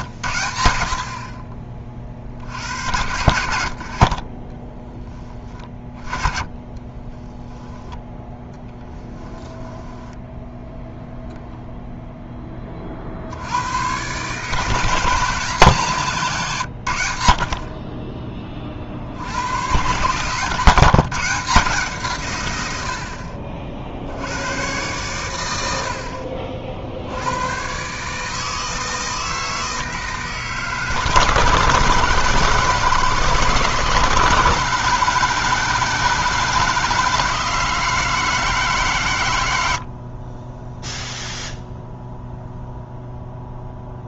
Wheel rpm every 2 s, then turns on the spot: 80, 70, 20, 20, 10, 0, 30, 160, 120, 40, 150, 90, 110, 60, 160, 150, 160, 160, 160, 150, 10, 0.
6-10